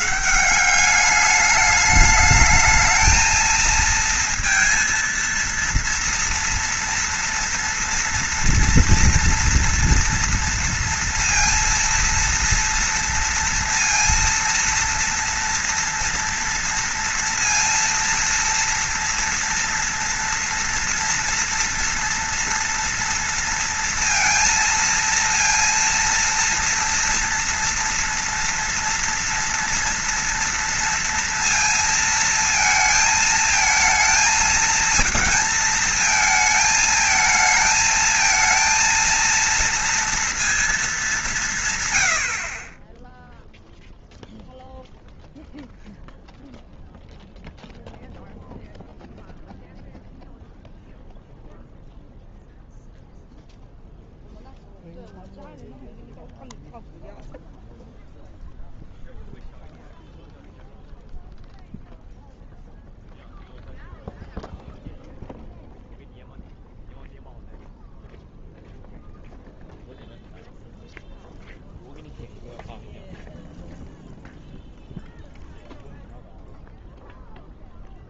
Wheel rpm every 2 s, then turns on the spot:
190, 220, 230, 230, 230, 230, 230, 230, 230, 230, 230, 230, 230, 230, 230, 230, 220, 220, 220, 220, 220, 20, 0, 0, 0, 0, 0, 0, 0, 0, 0, 0, 0, 0, 0, 0, 0, 0, 0.
none